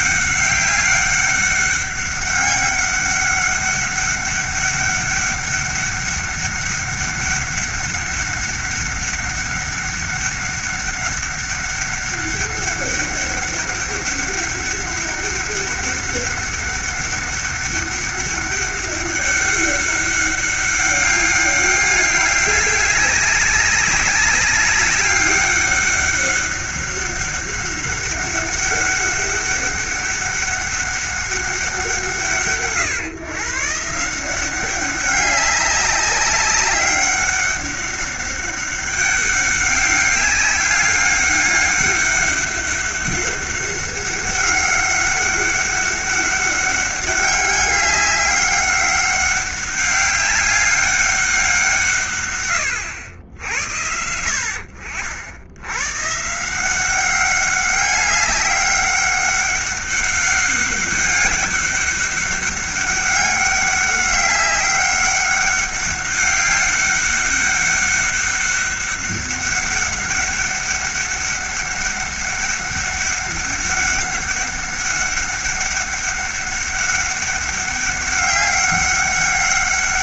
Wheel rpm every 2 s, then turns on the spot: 200, 200, 200, 200, 200, 200, 200, 200, 200, 200, 200, 200, 200, 200, 200, 200, 130, 190, 200, 200, 200, 200, 200, 200, 200, 200, 100, 70, 180, 200, 200, 200, 200, 200, 200, 200, 200, 200, 200, 200.
none